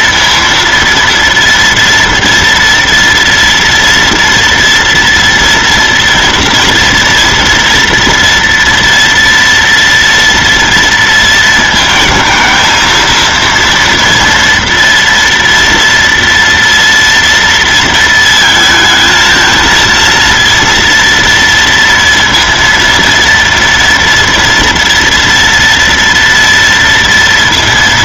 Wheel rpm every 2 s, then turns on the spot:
230, 230, 230, 230, 230, 230, 220, 230, 230, 220, 230, 230, 230, 230.
none